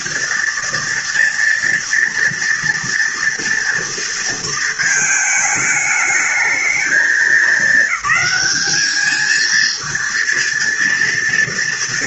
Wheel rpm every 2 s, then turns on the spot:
230, 240, 220, 220, 220, 230.
none